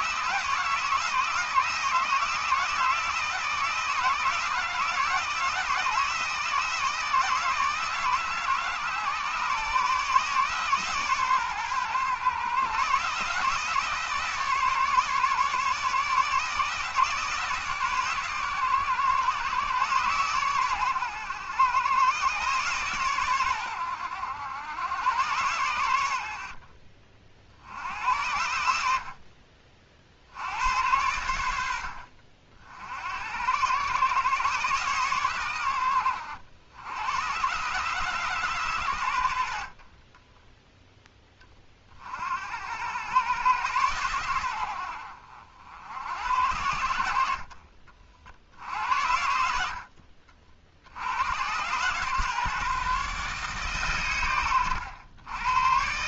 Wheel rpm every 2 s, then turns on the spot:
160, 160, 160, 160, 150, 140, 140, 150, 160, 130, 120, 130, 100, 40, 70, 90, 60, 130, 90, 130, 10, 80, 80, 80, 70, 60, 140, 100.
48-50